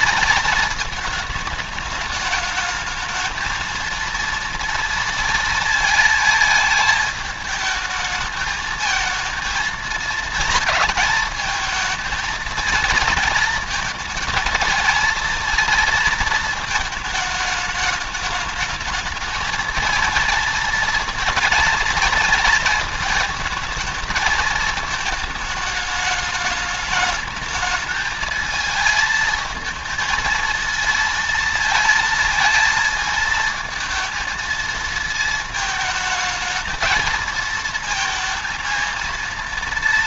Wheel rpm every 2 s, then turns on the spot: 220, 210, 230, 220, 220, 230, 230, 230, 220, 210, 230, 230, 220, 210, 220, 230, 220, 220, 220, 220.
none